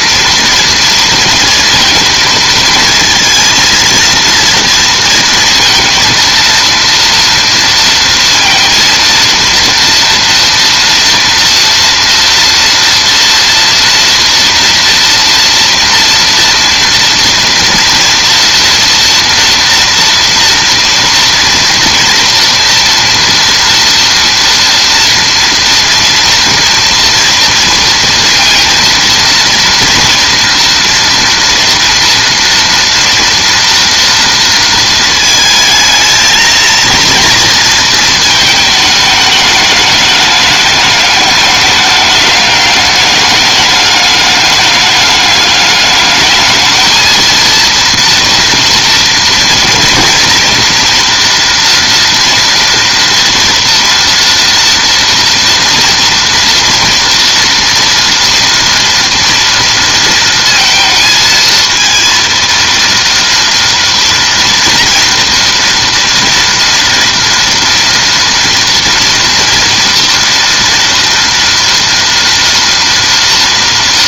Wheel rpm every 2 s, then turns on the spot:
230, 220, 230, 230, 230, 230, 230, 230, 230, 230, 230, 230, 240, 240, 230, 230, 230, 230, 230, 220, 210, 200, 210, 220, 230, 230, 230, 230, 230, 230, 230, 230, 230, 230, 230, 230, 230.
none